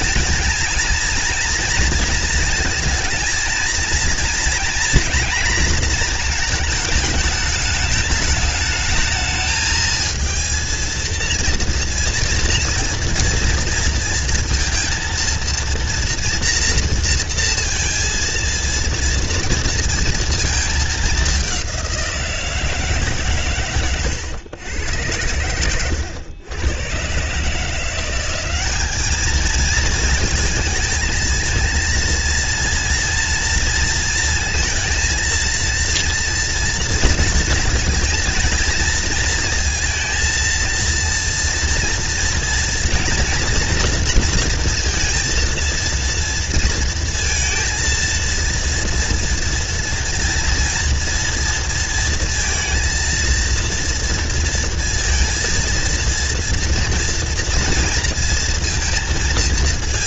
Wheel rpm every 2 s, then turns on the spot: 230, 230, 240, 220, 220, 230, 230, 230, 240, 230, 220, 160, 110, 100, 200, 220, 230, 230, 230, 230, 230, 230, 230, 230, 230, 230, 230, 230, 230, 230.
none